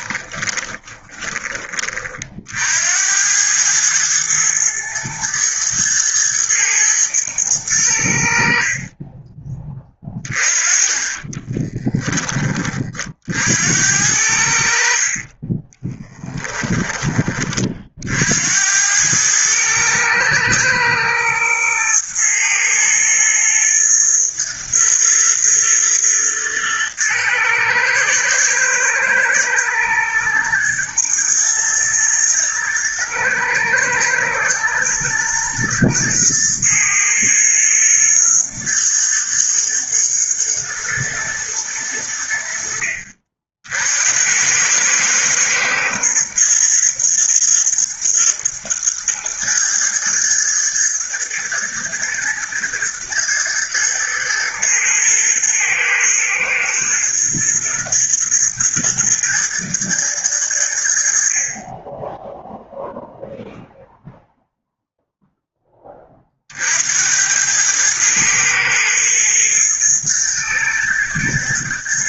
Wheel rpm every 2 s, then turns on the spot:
20, 80, 110, 120, 30, 20, 40, 40, 20, 90, 110, 120, 120, 110, 110, 110, 120, 110, 110, 110, 110, 60, 110, 120, 120, 120, 110, 120, 120, 110, 70, 0, 0, 80, 110, 110.
0-2